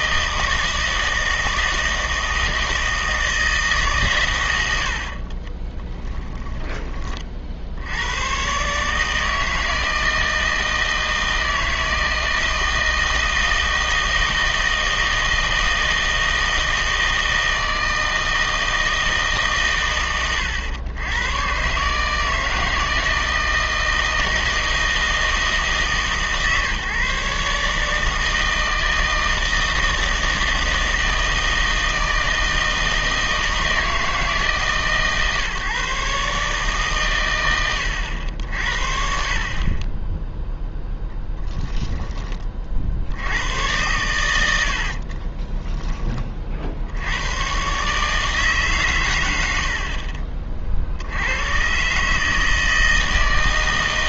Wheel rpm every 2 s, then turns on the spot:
160, 160, 80, 20, 140, 160, 160, 160, 160, 160, 110, 160, 160, 140, 160, 160, 160, 140, 140, 70, 0, 50, 70, 60, 130, 50, 160.
44-46